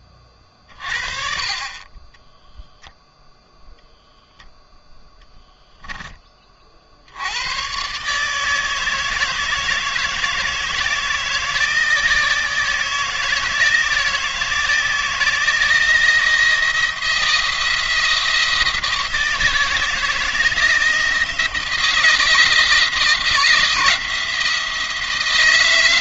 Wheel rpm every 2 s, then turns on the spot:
30, 0, 0, 50, 160, 160, 160, 160, 170, 160, 160, 160, 170.
none